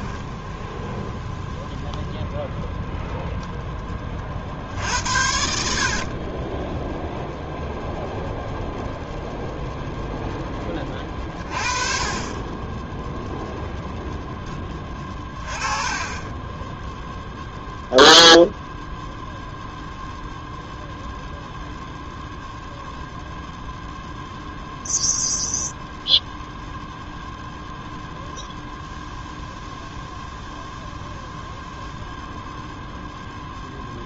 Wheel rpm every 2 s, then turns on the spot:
0, 0, 60, 0, 0, 30, 0, 20, 0, 0, 0, 0, 0, 0, 0, 0, 0.
4-6 14-16